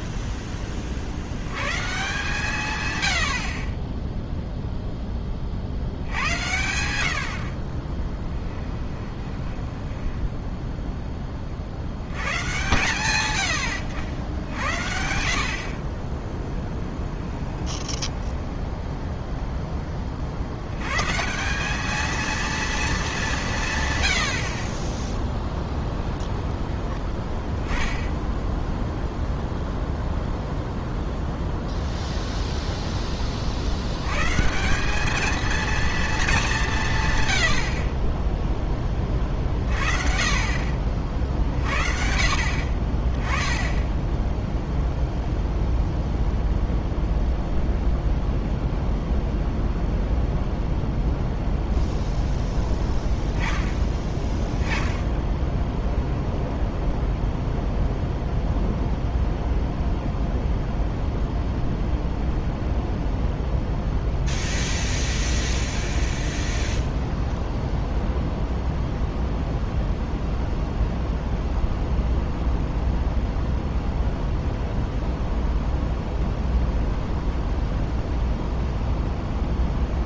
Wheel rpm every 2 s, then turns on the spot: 20, 120, 0, 90, 10, 10, 120, 70, 0, 10, 90, 230, 40, 20, 10, 0, 0, 170, 180, 20, 50, 50, 0, 0, 0, 0, 10, 10, 0, 0, 0, 0, 0, 20, 0, 0, 0, 0, 0, 0.
8-12 66-68